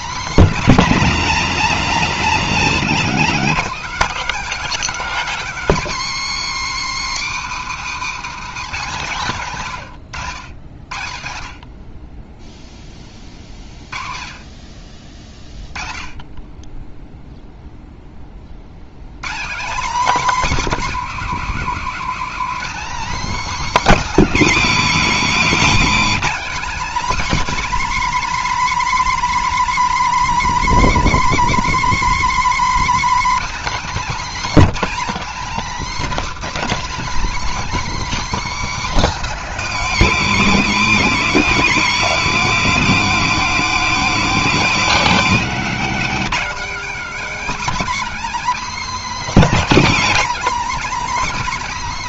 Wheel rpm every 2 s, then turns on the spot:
240, 220, 260, 190, 190, 90, 10, 30, 10, 60, 280, 270, 250, 270, 300, 310, 300, 260, 270, 270, 230, 240, 250, 270, 290, 280.
none